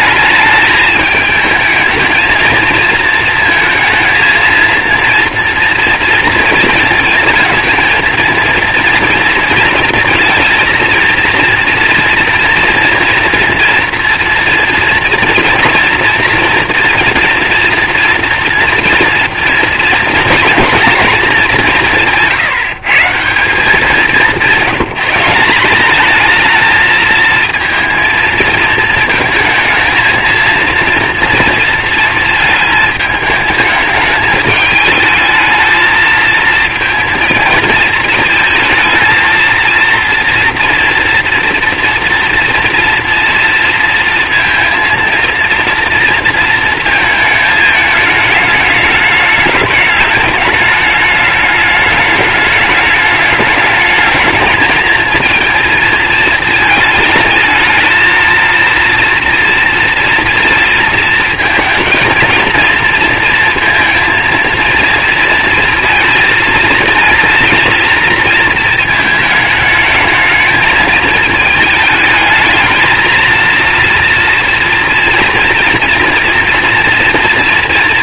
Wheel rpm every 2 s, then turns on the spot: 220, 220, 230, 230, 230, 230, 230, 230, 230, 230, 220, 170, 180, 220, 220, 230, 210, 220, 230, 220, 230, 230, 230, 220, 210, 210, 210, 220, 220, 230, 220, 230, 230, 230, 220, 220, 230, 230, 230.
none